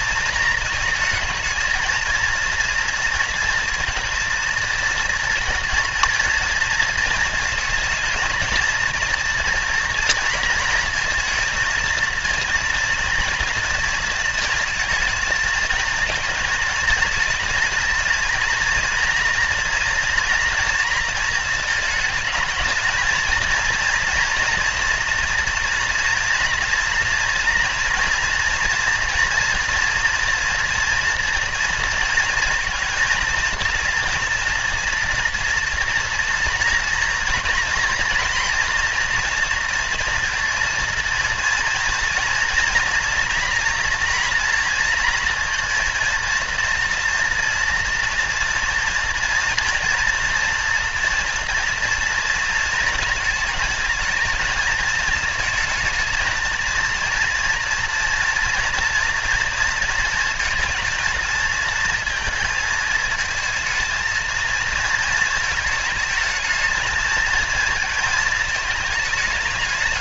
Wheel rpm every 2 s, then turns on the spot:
220, 230, 230, 230, 230, 230, 230, 220, 230, 230, 230, 220, 240, 230, 230, 230, 220, 230, 230, 240, 230, 230, 230, 230, 230, 230, 230, 220, 230, 230, 220, 220, 230, 220, 220.
none